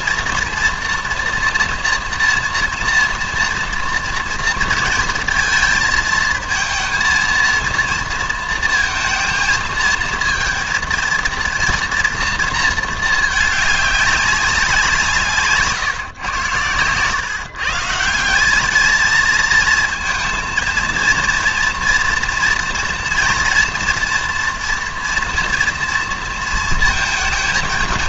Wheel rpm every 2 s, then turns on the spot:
230, 230, 230, 230, 230, 230, 230, 190, 120, 210, 230, 230, 230, 220.
none